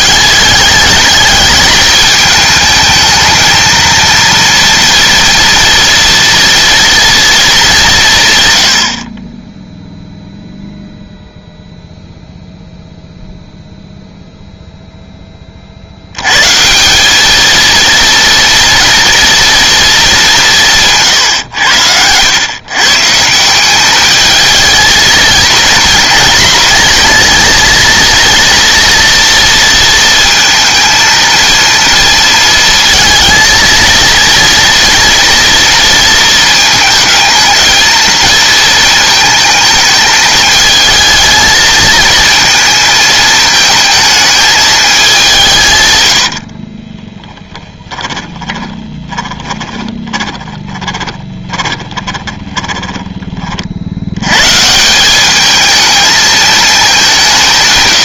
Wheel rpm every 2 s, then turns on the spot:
210, 220, 230, 240, 100, 0, 0, 0, 160, 230, 170, 120, 220, 220, 230, 230, 220, 230, 220, 220, 220, 220, 220, 50, 20, 20, 20, 140, 220.
46-54